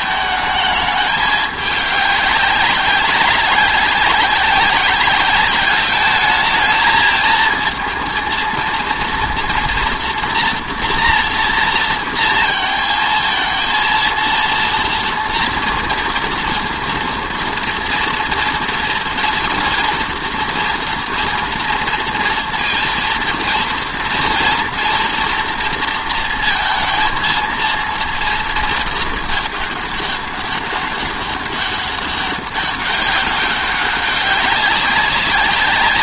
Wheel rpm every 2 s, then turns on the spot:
210, 190, 190, 220, 230, 230, 220, 230, 230, 230, 230, 230, 230, 230, 220, 200, 200, 200.
none